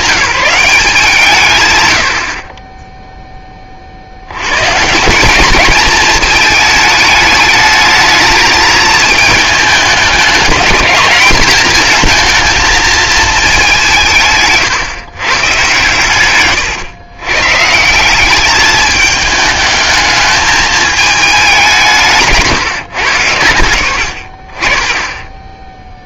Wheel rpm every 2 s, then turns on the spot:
180, 20, 140, 210, 220, 220, 230, 140, 120, 210, 210, 160, 30.
none